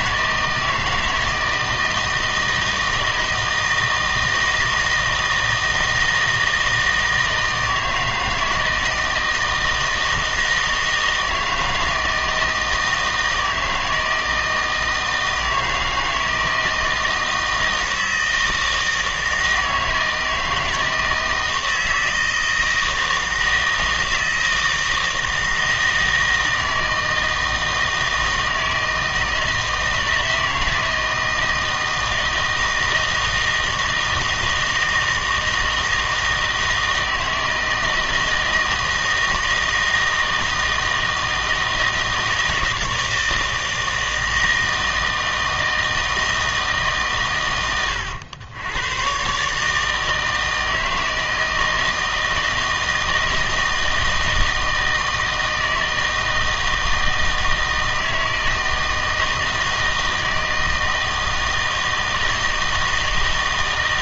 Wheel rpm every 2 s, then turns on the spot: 160, 160, 160, 160, 160, 160, 160, 160, 160, 160, 160, 160, 160, 160, 160, 160, 160, 160, 160, 160, 160, 160, 160, 140, 100, 160, 160, 160, 160, 160, 160, 160.
none